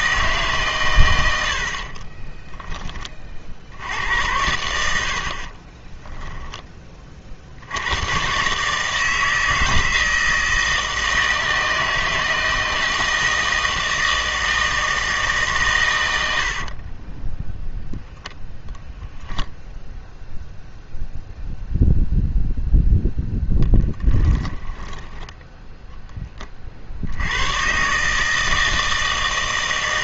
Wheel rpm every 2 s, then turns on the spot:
140, 10, 80, 20, 150, 160, 160, 160, 40, 0, 0, 0, 10, 50, 160.
16-18 24-26